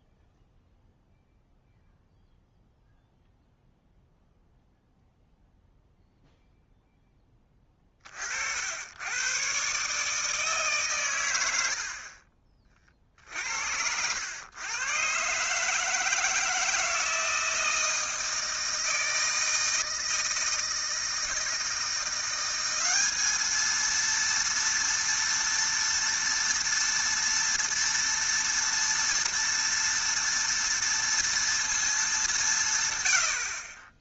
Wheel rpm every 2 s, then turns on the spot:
0, 0, 0, 0, 70, 150, 40, 110, 160, 160, 160, 190, 230, 230, 230, 230, 140.
none